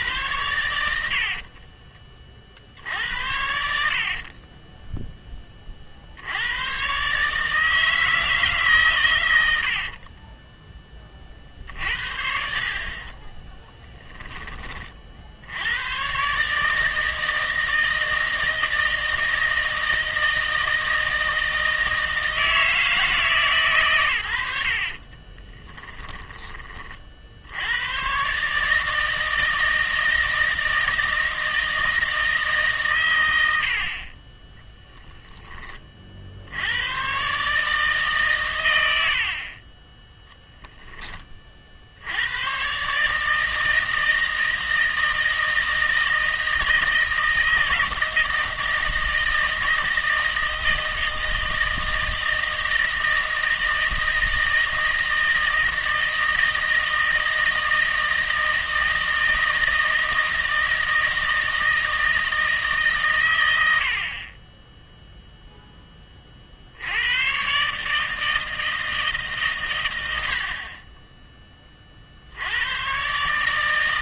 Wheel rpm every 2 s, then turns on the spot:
80, 70, 20, 120, 140, 10, 50, 40, 160, 160, 160, 160, 60, 40, 150, 160, 140, 20, 90, 100, 10, 140, 160, 160, 160, 160, 160, 160, 160, 160, 160, 140, 10, 70, 160, 30, 100.
2-6 24-26 34-36